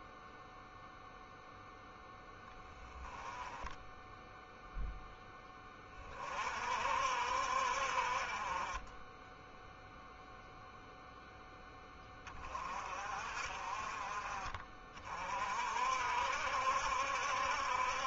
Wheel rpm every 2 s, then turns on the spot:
0, 10, 10, 60, 20, 0, 40, 40, 70.
none